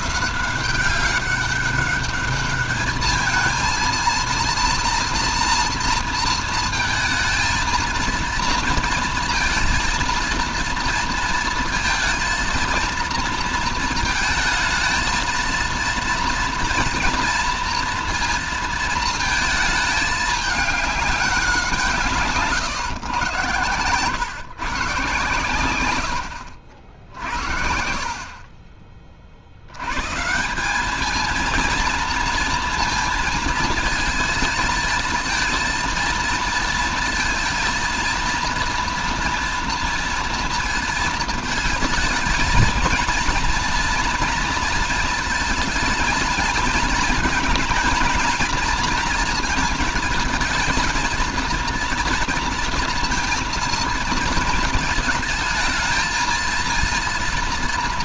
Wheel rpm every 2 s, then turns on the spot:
200, 230, 230, 230, 220, 230, 230, 230, 230, 220, 190, 110, 120, 60, 60, 220, 220, 220, 230, 230, 220, 230, 220, 220, 220, 220, 230, 220, 230.
none